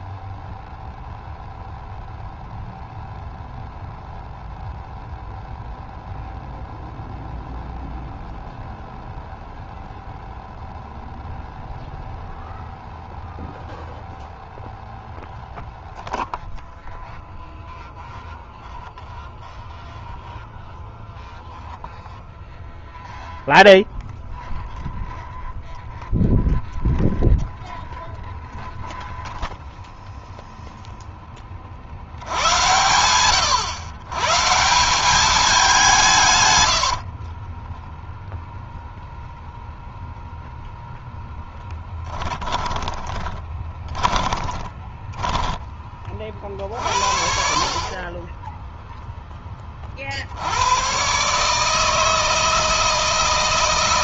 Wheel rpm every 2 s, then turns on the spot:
0, 0, 0, 0, 0, 0, 0, 0, 0, 0, 0, 0, 0, 0, 0, 0, 110, 190, 60, 0, 0, 20, 10, 50, 10, 120, 160.
36-38 42-46